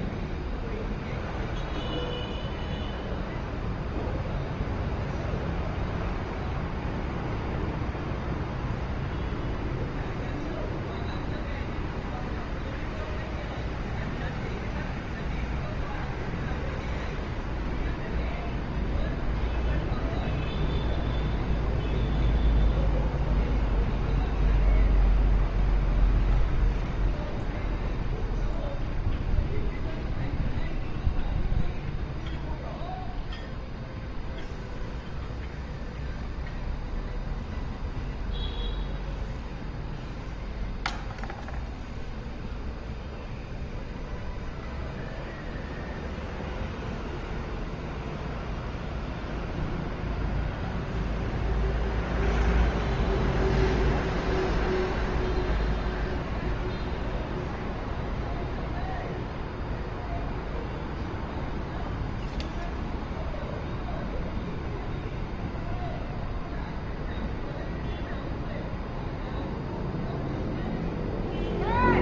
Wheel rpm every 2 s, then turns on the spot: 0, 0, 0, 0, 0, 0, 0, 0, 0, 0, 0, 0, 0, 0, 0, 0, 0, 0, 0, 0, 0, 0, 0, 0, 0, 0, 0, 0, 0, 0, 0, 0, 0, 0, 0, 0.
none